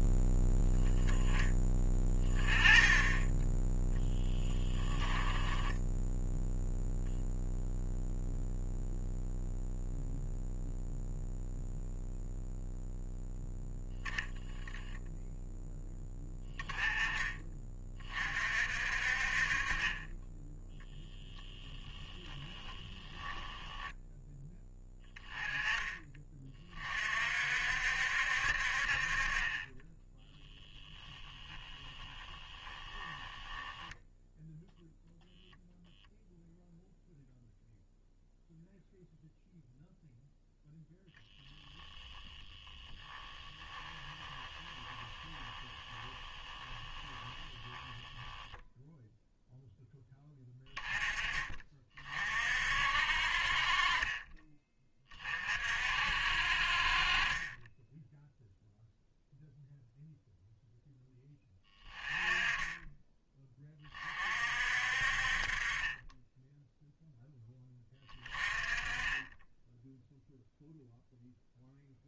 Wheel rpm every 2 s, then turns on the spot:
0, 20, 10, 0, 0, 0, 0, 10, 10, 50, 10, 20, 10, 30, 50, 10, 10, 0, 0, 0, 0, 10, 10, 20, 0, 30, 50, 20, 50, 0, 0, 20, 50, 0, 20, 0.
4-6 22-24 32-34 42-48